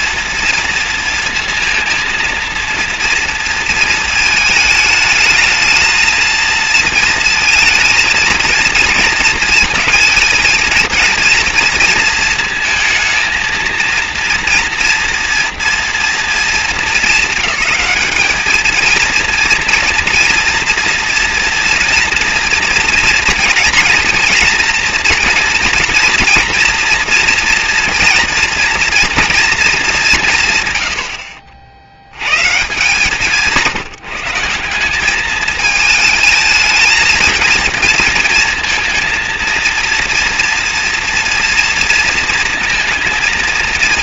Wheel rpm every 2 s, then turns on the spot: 230, 230, 220, 220, 230, 220, 230, 230, 220, 220, 230, 230, 230, 230, 230, 120, 140, 180, 220, 220, 230, 230.
none